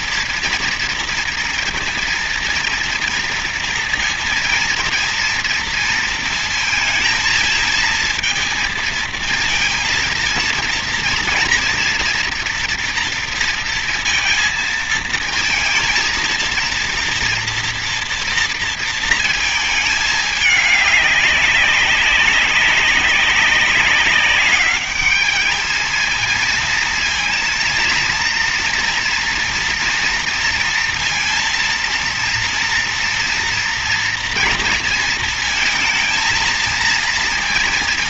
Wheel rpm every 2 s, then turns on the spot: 230, 230, 230, 230, 230, 230, 230, 230, 230, 230, 210, 200, 200, 230, 230, 230, 230, 230, 230.
none